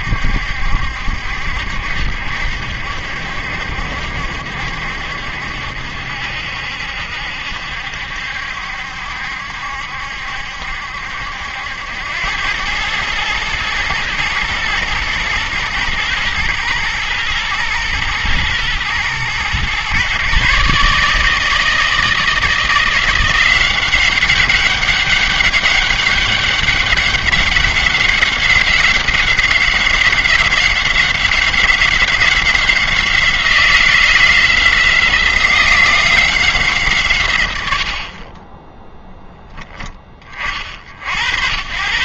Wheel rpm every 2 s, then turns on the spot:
70, 70, 70, 70, 70, 70, 100, 120, 110, 110, 140, 170, 200, 200, 190, 190, 180, 170, 140, 20, 60.
none